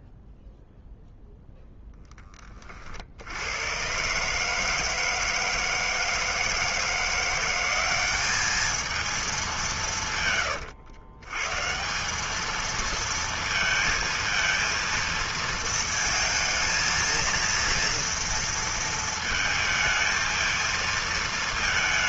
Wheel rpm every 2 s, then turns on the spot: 0, 0, 120, 160, 190, 190, 150, 220, 230, 230, 220.
none